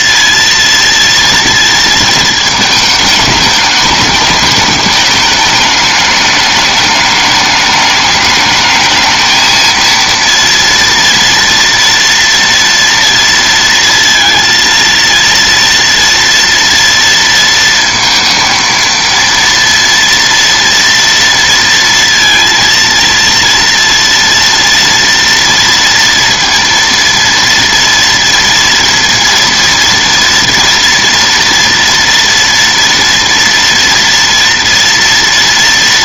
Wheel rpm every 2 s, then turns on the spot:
230, 220, 220, 210, 220, 230, 230, 230, 230, 230, 230, 230, 230, 230, 230, 230, 240, 230.
none